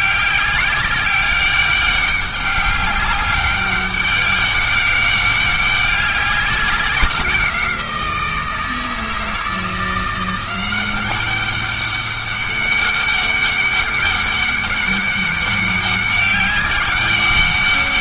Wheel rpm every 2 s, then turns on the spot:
200, 200, 200, 190, 160, 190, 200, 200, 200.
none